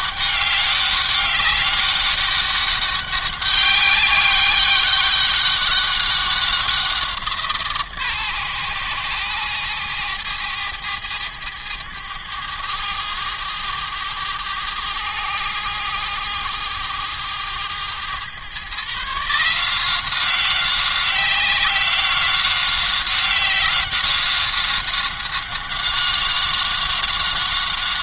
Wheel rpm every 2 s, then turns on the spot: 200, 200, 200, 180, 120, 110, 100, 110, 110, 140, 190, 190, 190, 190.
none